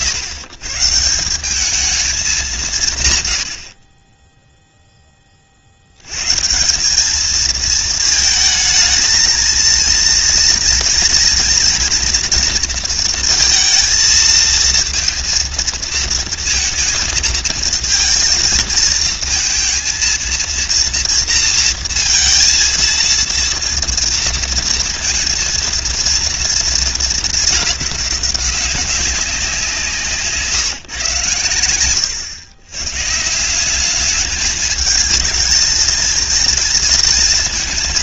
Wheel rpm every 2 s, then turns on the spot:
130, 170, 20, 210, 230, 230, 230, 230, 230, 220, 230, 230, 230, 220, 190, 120, 150, 220, 230.
none